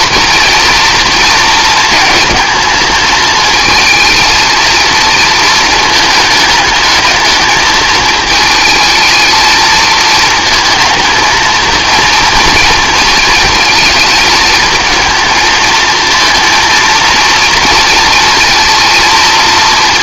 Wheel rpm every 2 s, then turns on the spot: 230, 220, 230, 210, 220, 220, 230, 230, 230, 230.
none